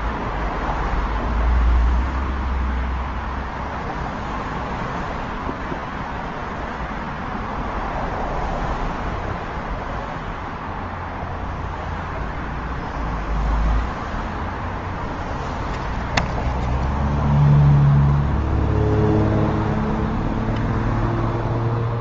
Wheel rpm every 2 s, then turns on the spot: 0, 0, 0, 0, 0, 0, 0, 0, 0, 0, 0.
none